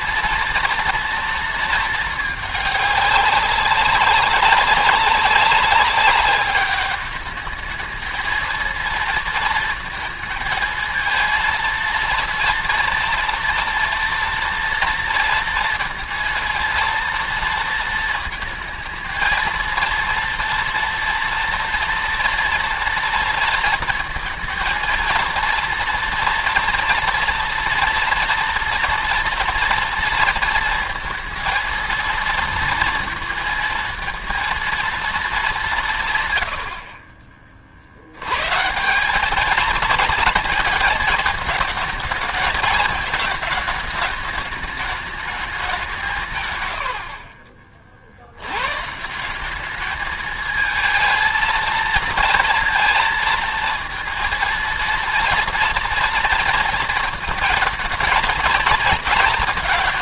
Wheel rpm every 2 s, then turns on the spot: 230, 210, 190, 200, 230, 230, 230, 230, 230, 230, 230, 230, 230, 230, 230, 230, 230, 230, 70, 150, 220, 220, 210, 100, 120, 220, 230, 230, 230, 230.
none